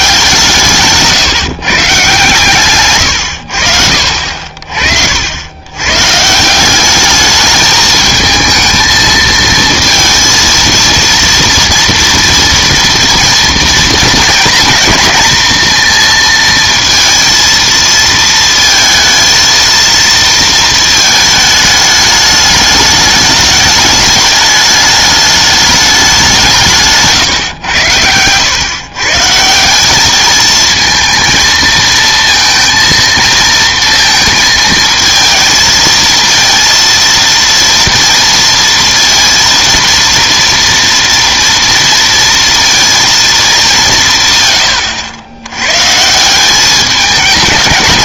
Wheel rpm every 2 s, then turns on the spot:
160, 130, 50, 180, 220, 230, 230, 230, 230, 230, 220, 210, 210, 160, 120, 220, 230, 220, 230, 230, 230, 230, 120, 200.
none